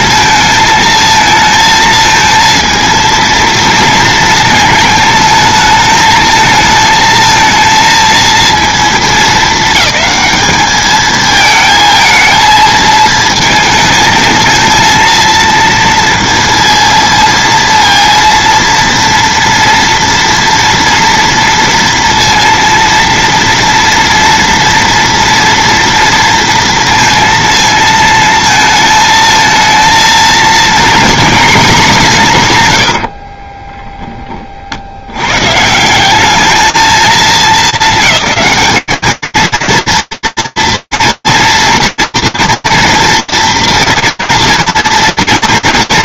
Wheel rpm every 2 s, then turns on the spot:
220, 230, 220, 220, 220, 210, 220, 230, 230, 230, 230, 230, 230, 230, 220, 240, 50, 60, 220, 220, 230, 230, 230.
32-34